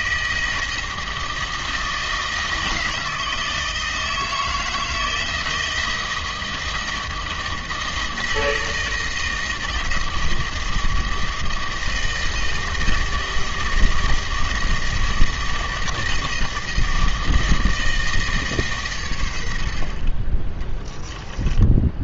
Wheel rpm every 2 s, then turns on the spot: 160, 160, 160, 160, 160, 160, 160, 160, 160, 140, 20.
none